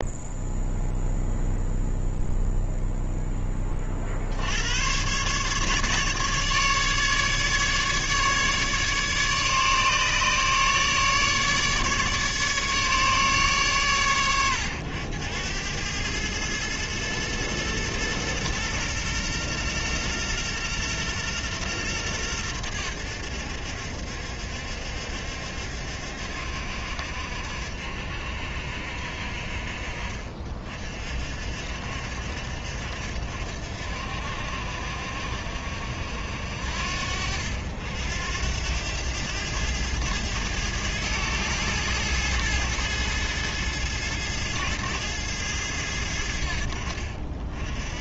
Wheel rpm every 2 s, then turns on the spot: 0, 0, 100, 150, 150, 150, 150, 90, 110, 120, 120, 100, 70, 70, 60, 40, 60, 60, 70, 90, 110, 110, 110, 60.
none